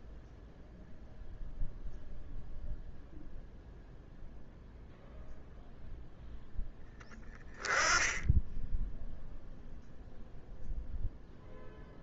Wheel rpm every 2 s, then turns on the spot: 0, 0, 0, 0, 10, 0.
none